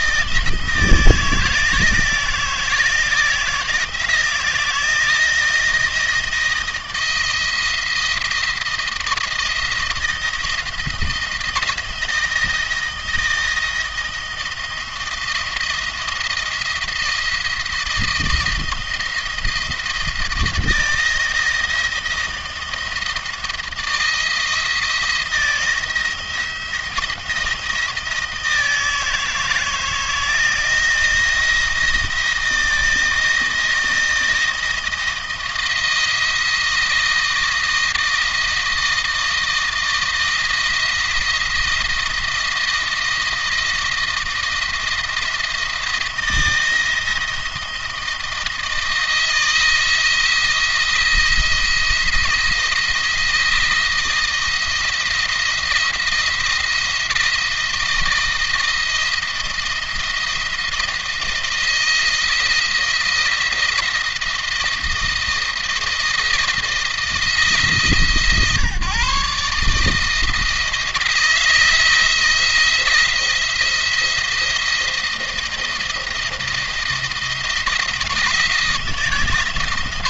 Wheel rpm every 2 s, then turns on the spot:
160, 170, 170, 160, 170, 170, 160, 170, 170, 170, 160, 170, 160, 170, 160, 160, 160, 170, 160, 160, 160, 170, 160, 170, 160, 160, 170, 170, 170, 170, 170, 170, 170, 160, 150, 160, 170, 170, 170, 170.
none